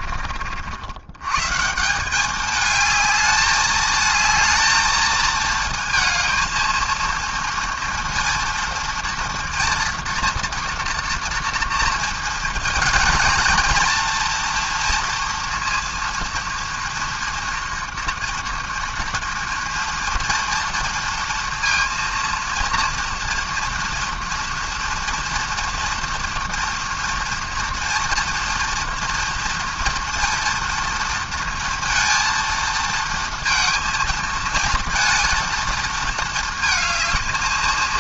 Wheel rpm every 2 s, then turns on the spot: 50, 210, 220, 230, 230, 230, 230, 240, 230, 230, 230, 230, 230, 240, 230, 230, 230, 220, 230.
none